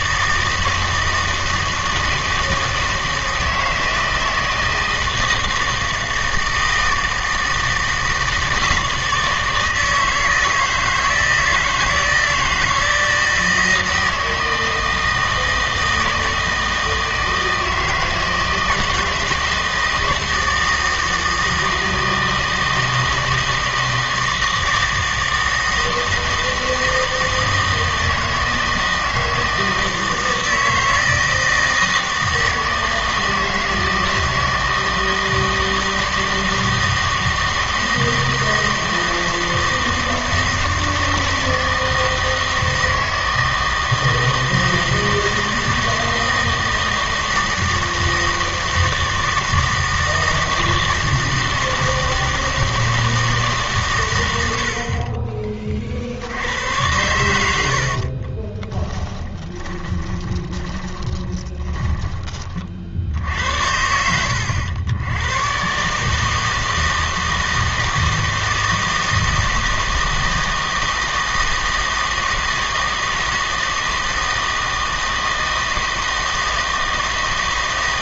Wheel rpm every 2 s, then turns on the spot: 160, 160, 160, 160, 160, 160, 160, 160, 160, 160, 160, 160, 160, 160, 160, 160, 160, 160, 160, 160, 160, 160, 160, 160, 160, 160, 160, 70, 100, 20, 20, 50, 90, 160, 160, 160, 160, 160, 160.
58-62